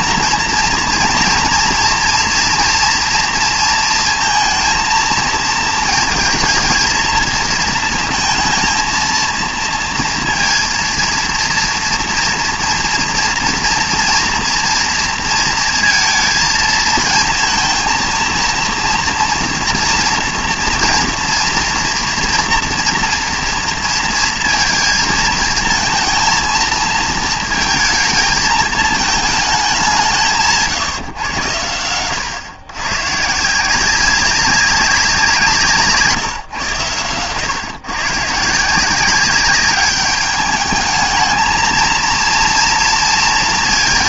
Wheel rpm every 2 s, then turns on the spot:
230, 240, 230, 220, 230, 230, 230, 230, 230, 230, 240, 230, 230, 230, 220, 160, 120, 190, 120, 160, 210, 230.
none